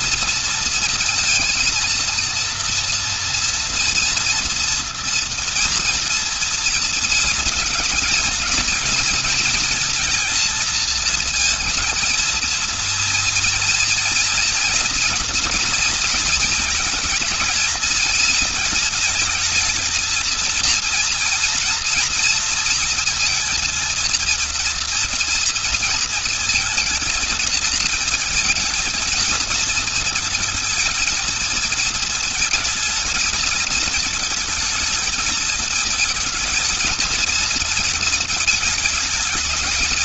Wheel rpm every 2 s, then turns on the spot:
230, 230, 230, 230, 220, 230, 230, 230, 230, 230, 230, 230, 230, 230, 230, 230, 230, 220, 230, 220.
none